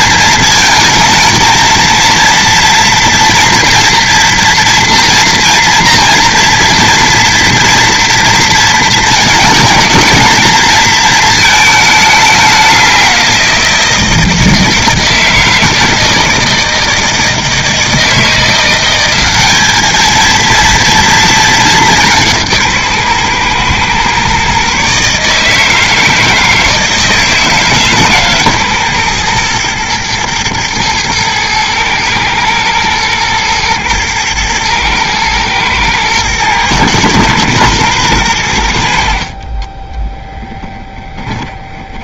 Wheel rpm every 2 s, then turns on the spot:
220, 230, 230, 240, 220, 230, 180, 160, 160, 190, 230, 140, 150, 160, 120, 110, 120, 110, 120, 70, 20.
40-42